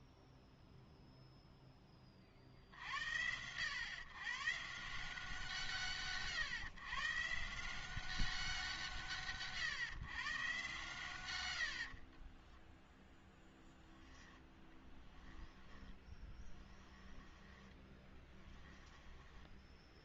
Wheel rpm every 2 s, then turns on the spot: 0, 60, 140, 130, 140, 120, 10, 10, 10, 10.
12-20